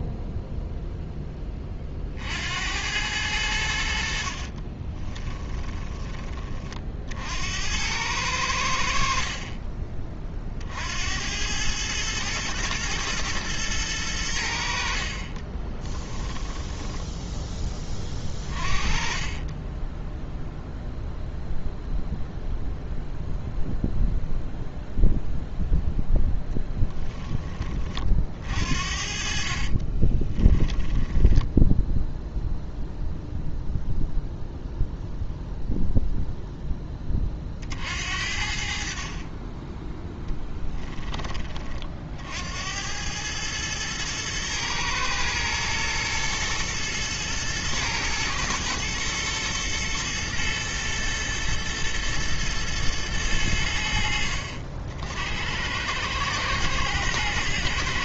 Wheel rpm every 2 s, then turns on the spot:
0, 90, 30, 60, 80, 60, 110, 60, 10, 30, 0, 0, 0, 10, 50, 10, 0, 0, 10, 50, 10, 90, 110, 120, 110, 120, 110, 60, 110.
4-6 16-18 26-28 30-32